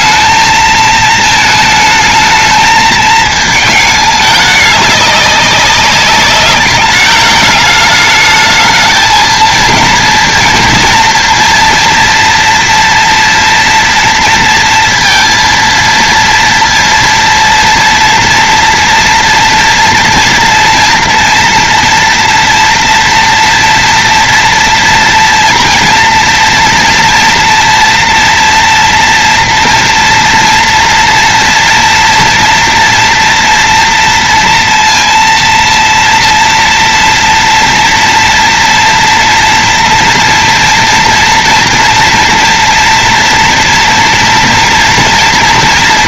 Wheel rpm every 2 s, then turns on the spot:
220, 220, 210, 200, 210, 230, 230, 230, 230, 230, 230, 230, 230, 240, 230, 230, 230, 230, 230, 230, 240, 230, 230.
none